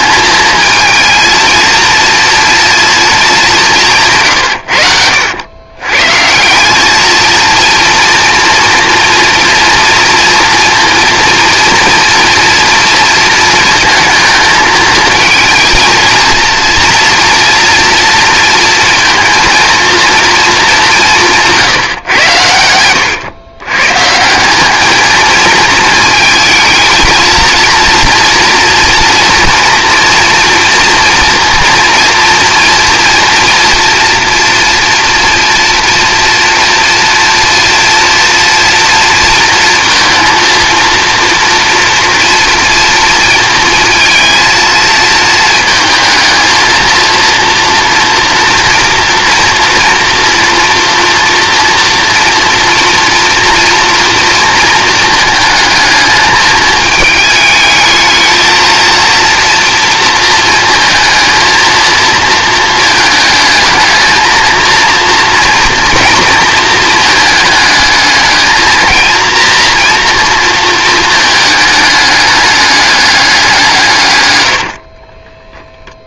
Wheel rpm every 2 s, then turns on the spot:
220, 230, 90, 200, 240, 230, 240, 220, 230, 230, 210, 100, 200, 220, 230, 230, 230, 240, 240, 230, 230, 230, 230, 230, 230, 230, 230, 230, 220, 230, 220, 220, 230, 230, 230, 230, 210, 60.
74-76